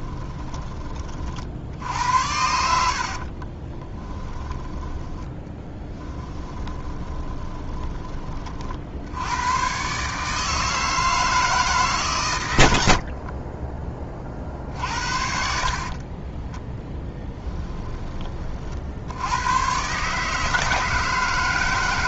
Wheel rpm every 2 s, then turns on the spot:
20, 80, 10, 20, 50, 160, 80, 50, 10, 50, 160.
2-8 14-16